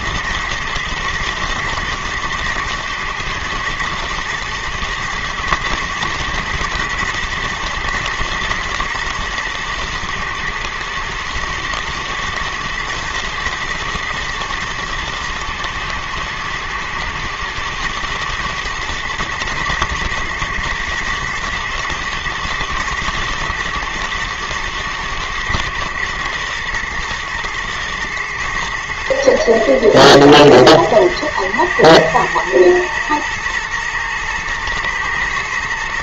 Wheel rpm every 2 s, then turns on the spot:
120, 120, 110, 120, 120, 110, 110, 110, 120, 120, 120, 120, 110, 110, 110, 110, 120, 110.
none